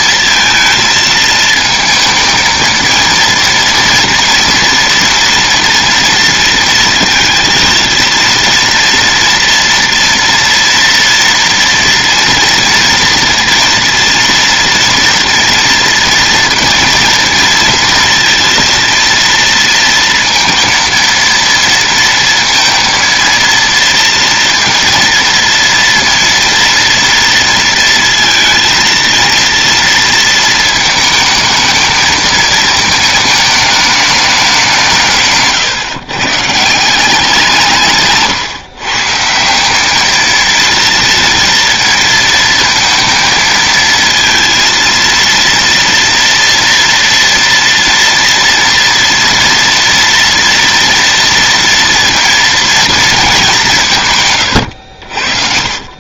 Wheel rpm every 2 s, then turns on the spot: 230, 220, 230, 230, 230, 230, 230, 230, 230, 230, 230, 230, 230, 230, 230, 230, 220, 200, 130, 150, 220, 230, 230, 230, 230, 230, 230, 140.
none